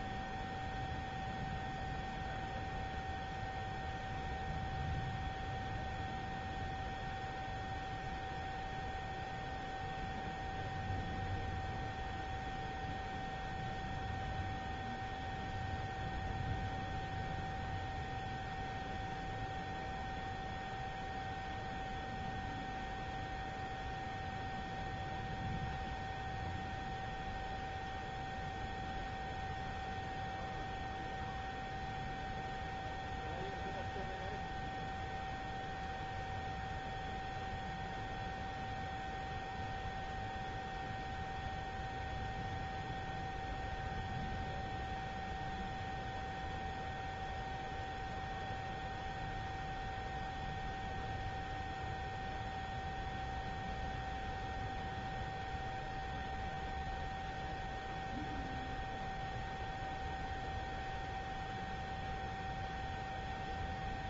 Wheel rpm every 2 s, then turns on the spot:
0, 0, 0, 0, 0, 0, 0, 0, 0, 0, 0, 0, 0, 0, 0, 0, 0, 0, 0, 0, 0, 0, 0, 0, 0, 0, 0, 0, 0, 0, 0, 0.
none